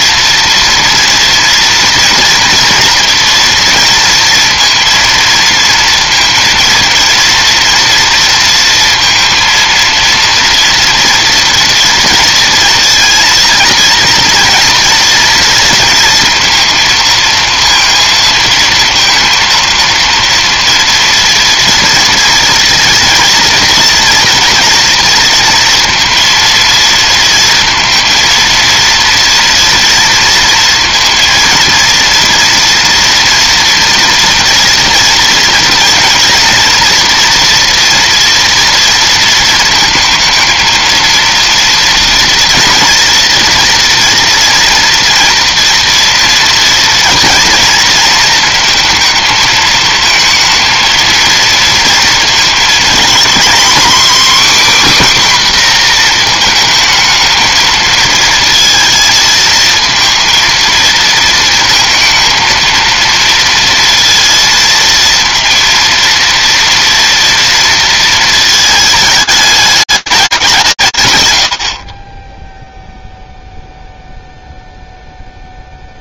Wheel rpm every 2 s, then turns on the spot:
230, 230, 230, 230, 230, 230, 230, 230, 230, 230, 230, 230, 240, 230, 230, 230, 230, 230, 240, 230, 220, 230, 230, 230, 230, 220, 230, 280, 230, 230, 230, 220, 230, 230, 220, 200, 20, 0.
none